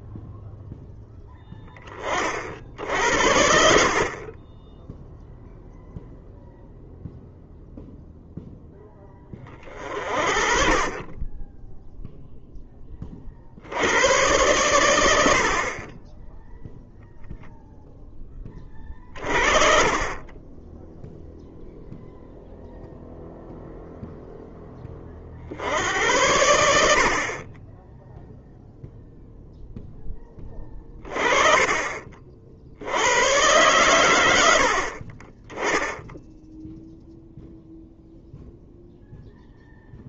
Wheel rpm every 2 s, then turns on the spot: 0, 70, 10, 0, 10, 30, 20, 100, 0, 30, 10, 0, 20, 70, 0, 30, 100, 50, 0, 0.
none